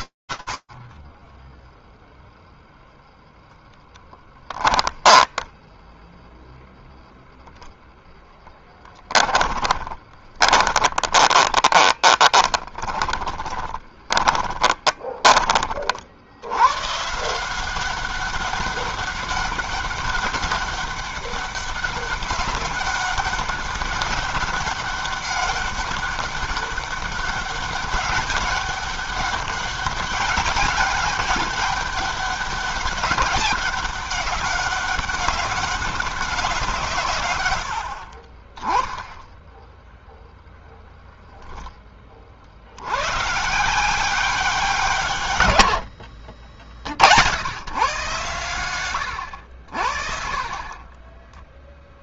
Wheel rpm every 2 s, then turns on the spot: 0, 10, 0, 10, 30, 20, 20, 60, 190, 200, 200, 200, 200, 200, 190, 200, 200, 190, 50, 0, 10, 130, 110, 100, 80, 10.
2-4 6-14 50-52